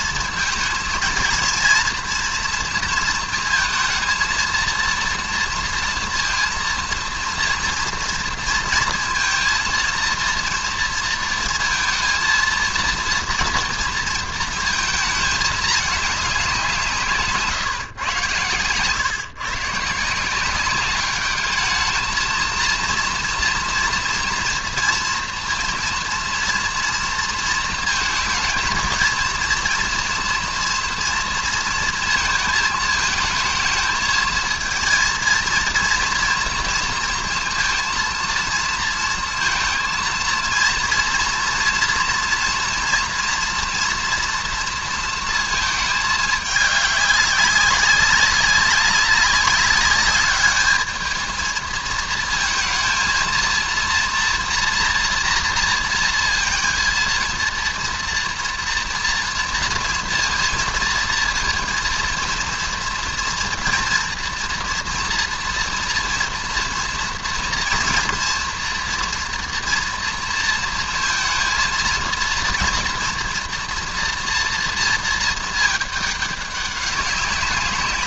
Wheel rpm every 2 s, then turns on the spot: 230, 230, 230, 230, 230, 230, 230, 230, 180, 120, 190, 230, 230, 230, 230, 230, 220, 220, 230, 230, 230, 240, 230, 210, 200, 210, 230, 240, 230, 230, 230, 230, 230, 240, 230, 230, 230, 230, 200.
none